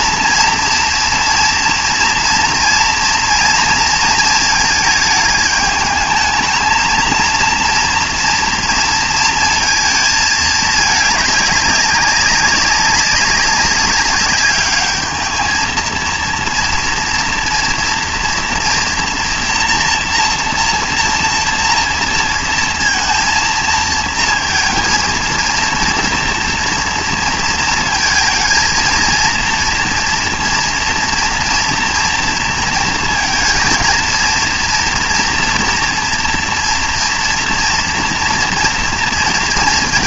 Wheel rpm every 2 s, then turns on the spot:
240, 230, 220, 220, 230, 210, 200, 200, 230, 240, 230, 230, 230, 230, 230, 230, 230, 230, 230, 230.
none